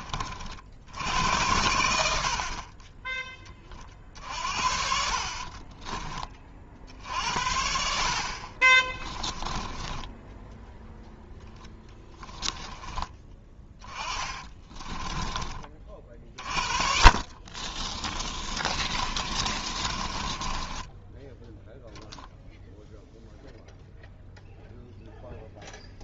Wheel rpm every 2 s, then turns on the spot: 70, 10, 60, 60, 20, 0, 10, 20, 50, 40, 10, 0, 0.
4-6 8-10 14-22